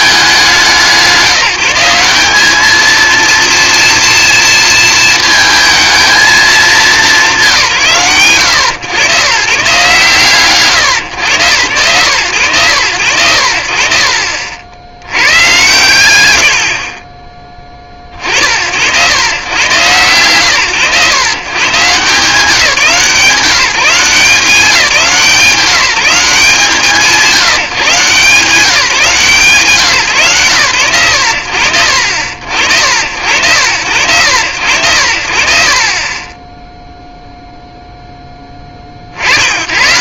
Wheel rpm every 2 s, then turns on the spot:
160, 230, 220, 180, 120, 120, 90, 80, 60, 110, 120, 160, 180, 150, 160, 90, 70, 80, 0, 10.
none